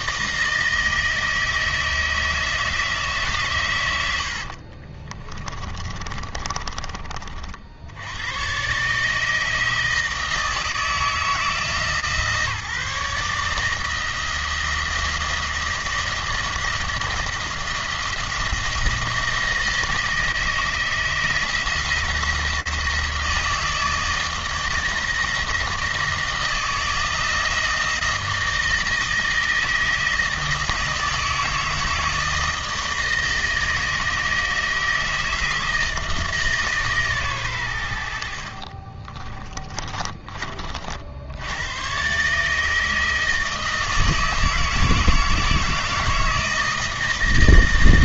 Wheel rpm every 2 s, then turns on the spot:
160, 160, 50, 30, 150, 160, 150, 170, 170, 160, 160, 160, 160, 160, 160, 160, 160, 160, 140, 30, 50, 160, 160, 160.
4-6 38-40